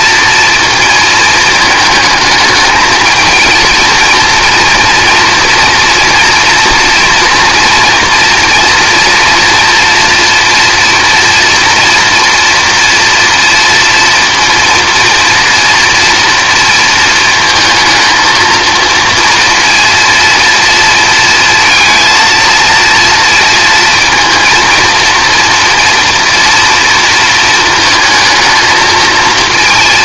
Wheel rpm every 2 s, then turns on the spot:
230, 220, 230, 230, 230, 240, 230, 230, 230, 230, 230, 230, 230, 230, 230.
none